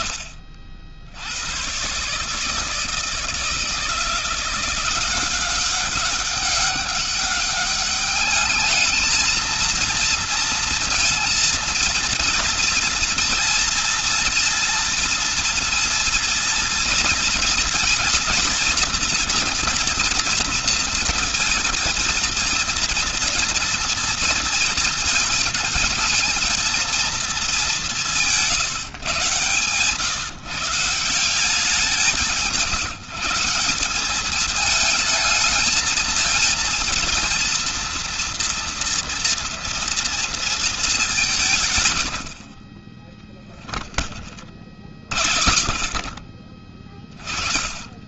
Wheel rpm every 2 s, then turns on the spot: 70, 150, 180, 200, 210, 230, 230, 230, 230, 230, 230, 230, 230, 230, 140, 160, 160, 220, 230, 230, 200, 20, 60, 40.
none